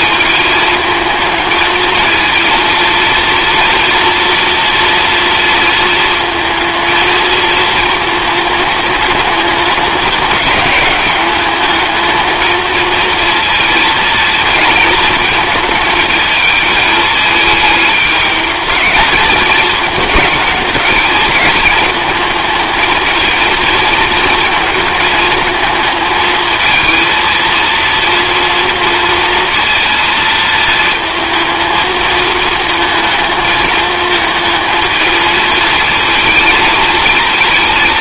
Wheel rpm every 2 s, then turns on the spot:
220, 230, 230, 230, 220, 200, 230, 220, 220, 220, 210, 220, 220, 230, 230, 220, 220, 220, 220.
none